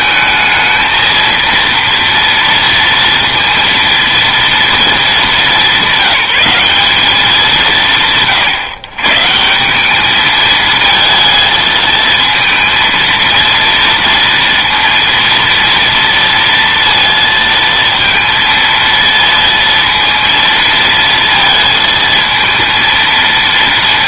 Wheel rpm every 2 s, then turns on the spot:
220, 230, 220, 190, 140, 220, 230, 230, 230, 230, 230, 230.
none